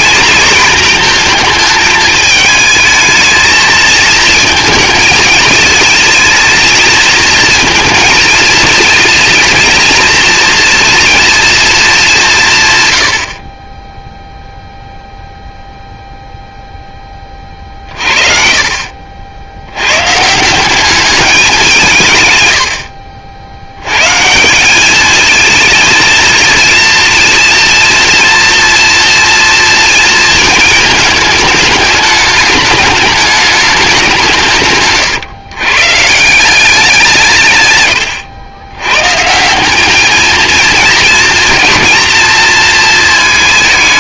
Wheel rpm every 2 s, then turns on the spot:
230, 220, 230, 230, 230, 230, 120, 0, 10, 50, 200, 90, 200, 230, 240, 220, 210, 140, 180, 110, 220, 230.
none